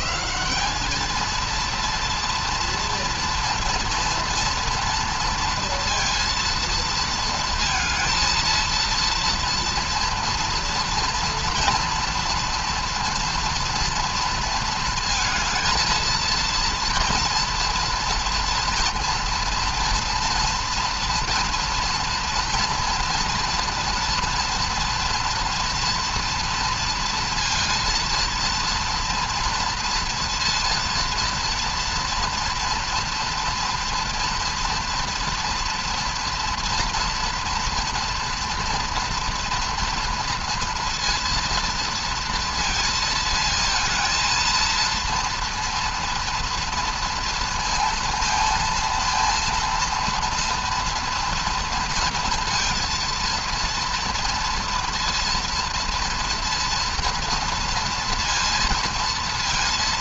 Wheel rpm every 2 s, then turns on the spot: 200, 230, 230, 230, 230, 230, 240, 230, 230, 230, 230, 230, 240, 230, 230, 230, 240, 230, 230, 230, 230, 230, 230, 230, 230, 230, 230, 230, 230, 230.
none